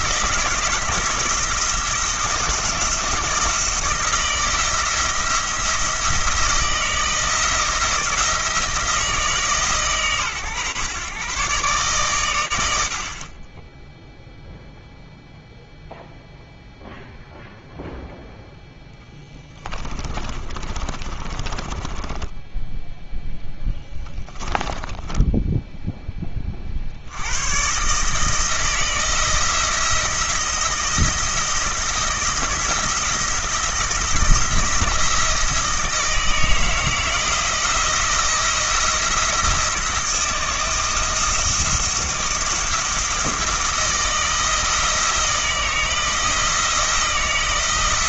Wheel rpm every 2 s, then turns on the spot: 160, 170, 160, 160, 160, 130, 80, 0, 0, 10, 30, 0, 20, 90, 160, 160, 170, 170, 170, 170, 160, 170, 160, 170.
20-22 24-26